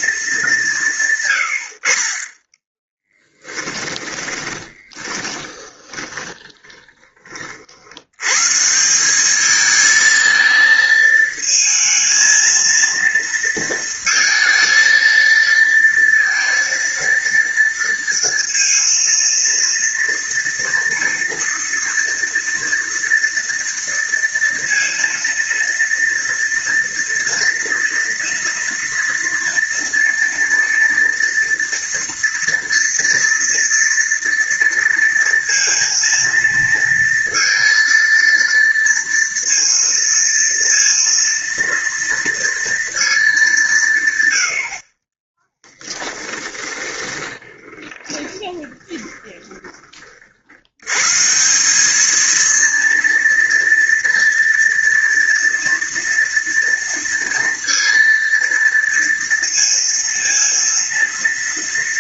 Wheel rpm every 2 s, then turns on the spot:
170, 20, 20, 20, 170, 220, 230, 230, 230, 230, 230, 230, 230, 230, 230, 230, 230, 230, 230, 230, 230, 230, 70, 20, 20, 100, 230, 230, 230, 230, 230.
2-8 46-50